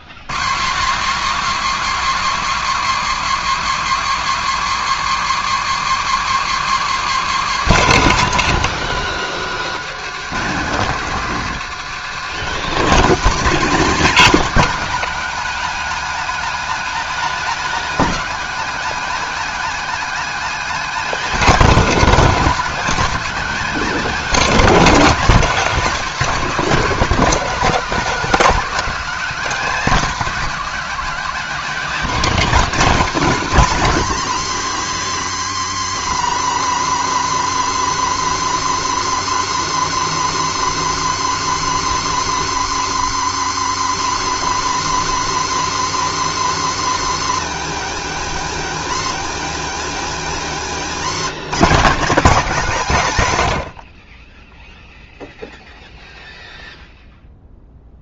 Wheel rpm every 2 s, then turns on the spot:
150, 230, 220, 220, 190, 200, 190, 240, 270, 260, 250, 250, 250, 220, 250, 260, 240, 150, 130, 140, 140, 140, 140, 130, 110, 110, 210, 0, 0.
50-52